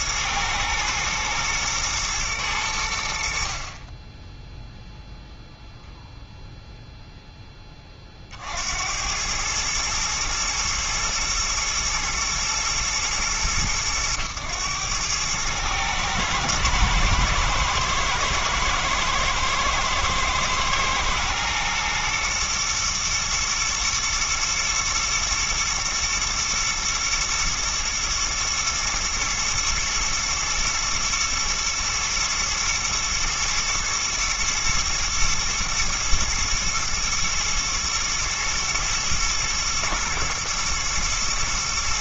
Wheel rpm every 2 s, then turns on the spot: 120, 90, 0, 0, 70, 120, 110, 100, 110, 110, 110, 120, 120, 110, 110, 120, 110, 110, 110, 110, 110.
none